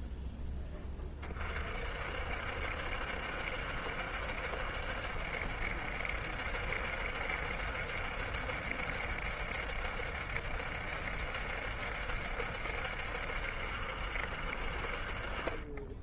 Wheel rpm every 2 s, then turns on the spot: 10, 60, 70, 70, 70, 70, 70, 60.
none